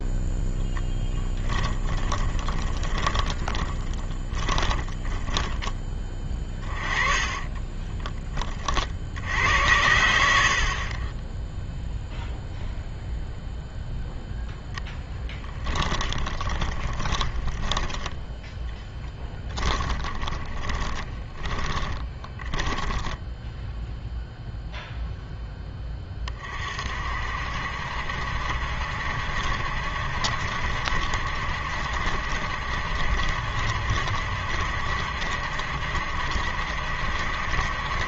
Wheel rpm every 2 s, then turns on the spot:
10, 20, 10, 20, 50, 40, 0, 0, 20, 10, 20, 10, 0, 50, 70, 70, 70, 60, 70.
2-8 16-24